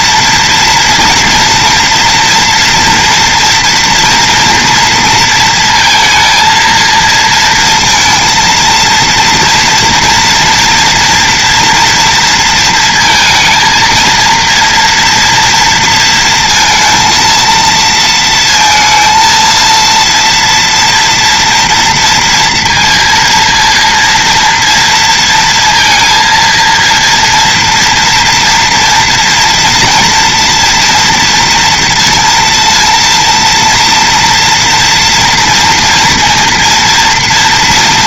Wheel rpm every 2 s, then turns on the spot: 230, 230, 230, 230, 230, 240, 230, 230, 230, 230, 240, 230, 230, 230, 230, 230, 230, 230, 230.
none